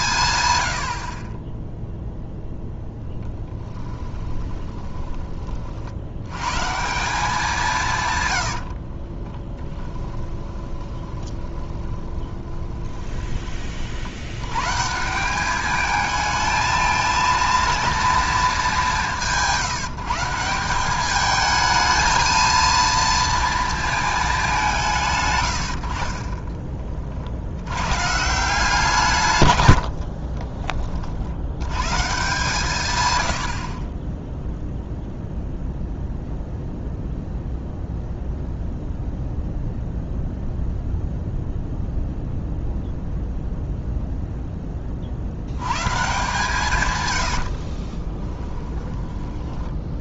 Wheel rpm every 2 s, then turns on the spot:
90, 0, 30, 140, 90, 10, 20, 120, 220, 210, 180, 230, 190, 20, 170, 30, 140, 0, 0, 0, 0, 0, 10, 140, 10.
4-6 8-14